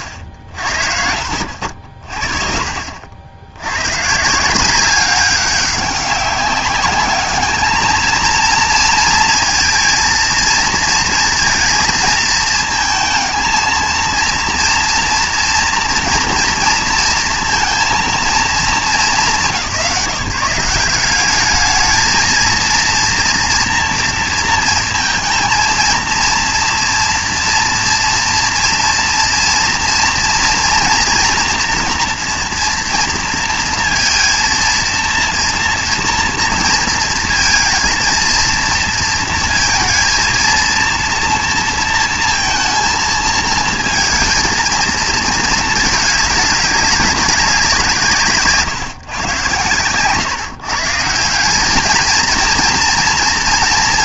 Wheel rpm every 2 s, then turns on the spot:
60, 60, 170, 200, 230, 230, 220, 230, 230, 230, 160, 230, 230, 230, 230, 240, 230, 230, 230, 230, 230, 230, 220, 200, 140, 150, 230.
none